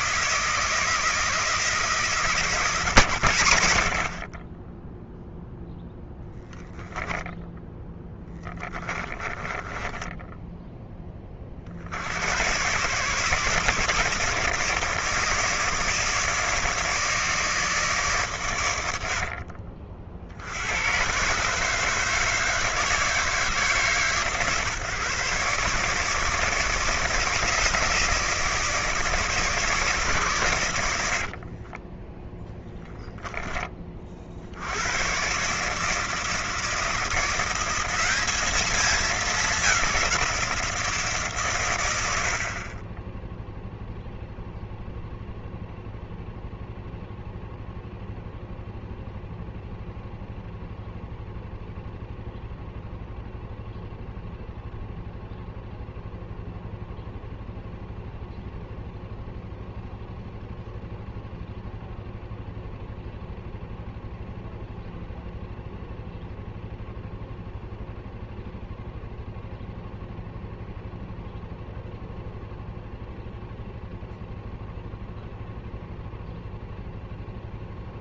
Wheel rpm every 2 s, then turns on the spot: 160, 110, 10, 10, 20, 20, 140, 160, 150, 100, 100, 160, 140, 160, 150, 90, 0, 90, 160, 210, 160, 30, 0, 0, 0, 0, 0, 0, 0, 0, 0, 0, 0, 0, 0, 0, 0, 0, 0.
8-10